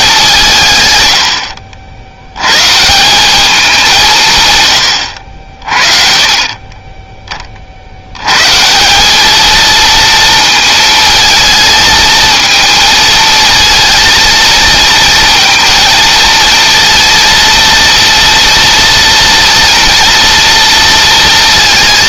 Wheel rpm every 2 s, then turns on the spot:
120, 160, 90, 10, 180, 220, 220, 220, 230, 230, 230.
none